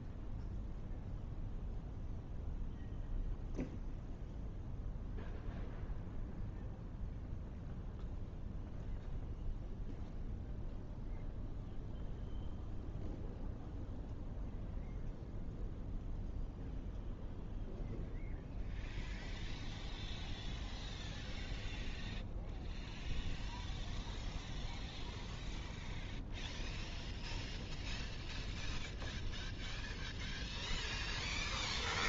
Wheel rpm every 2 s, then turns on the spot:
0, 0, 0, 0, 0, 0, 0, 0, 0, 0, 0, 0, 0, 0, 0, 0.
none